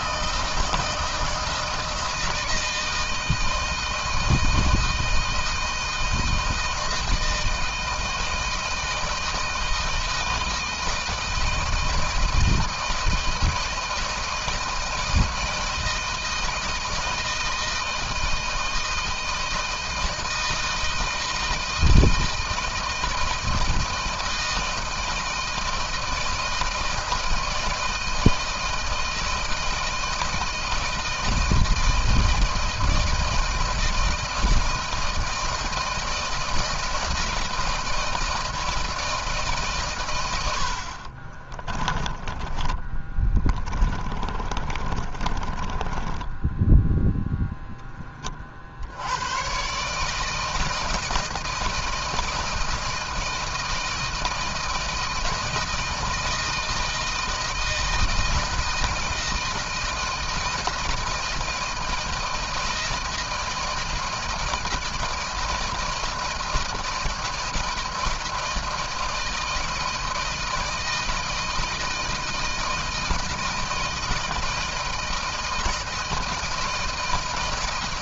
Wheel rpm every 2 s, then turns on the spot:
160, 160, 160, 160, 160, 160, 160, 160, 160, 160, 160, 160, 160, 160, 160, 160, 160, 160, 160, 160, 60, 20, 30, 10, 70, 160, 160, 160, 160, 160, 160, 160, 160, 160, 160, 160, 160, 160, 160.
40-42 44-46